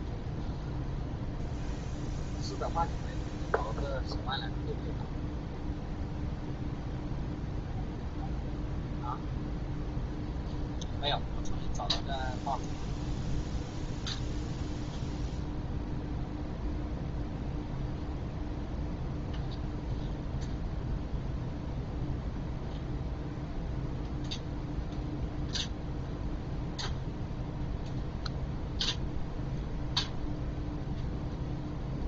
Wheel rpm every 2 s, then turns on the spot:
0, 0, 0, 0, 0, 0, 0, 0, 0, 0, 0, 0, 0, 0, 0, 0.
none